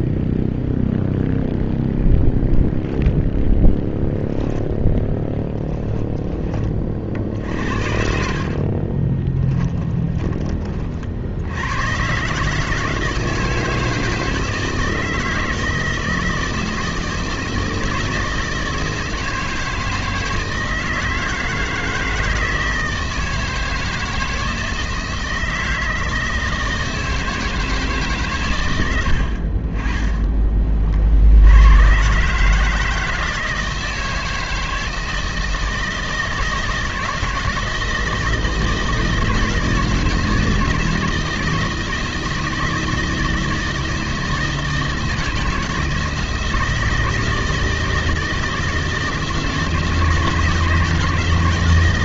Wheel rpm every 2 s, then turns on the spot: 0, 0, 10, 40, 40, 50, 160, 160, 160, 160, 160, 160, 160, 160, 100, 50, 160, 160, 160, 160, 160, 160, 160, 160, 160, 160.
4-6 8-10